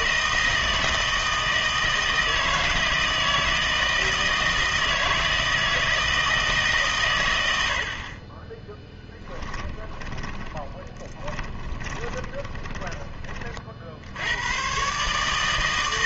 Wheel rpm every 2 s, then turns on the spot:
160, 160, 160, 150, 10, 20, 20, 130.
10-14